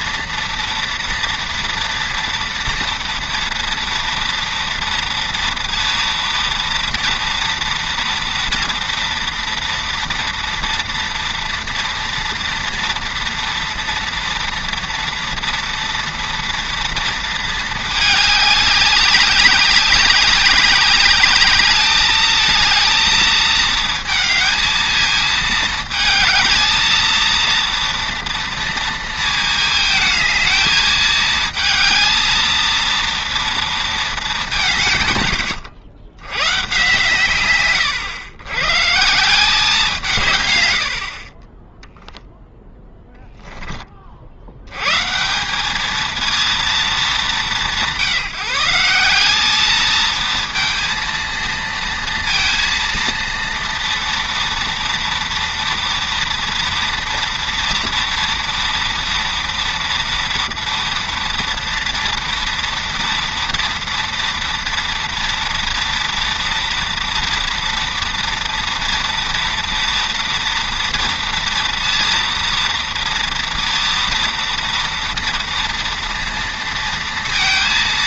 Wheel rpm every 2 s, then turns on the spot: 230, 240, 230, 230, 230, 230, 230, 230, 230, 200, 190, 220, 220, 220, 230, 220, 230, 180, 120, 110, 110, 0, 90, 230, 170, 230, 230, 230, 230, 230, 230, 230, 230, 230, 240, 230, 230, 230, 230.
none